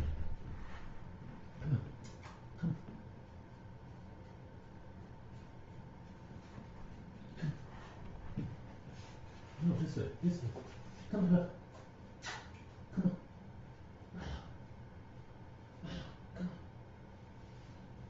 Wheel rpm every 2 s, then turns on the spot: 0, 0, 0, 0, 0, 0, 0, 0, 0.
none